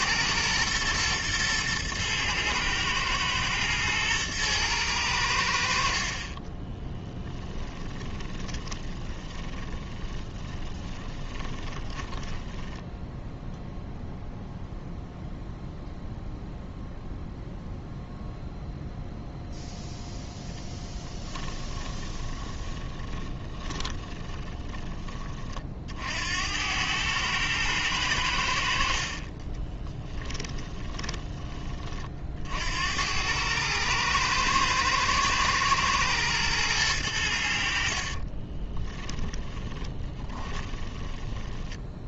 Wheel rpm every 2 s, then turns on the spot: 110, 110, 110, 20, 20, 20, 10, 0, 0, 0, 10, 10, 20, 100, 60, 20, 80, 110, 100, 20, 20.
6-12 22-26 28-32 38-42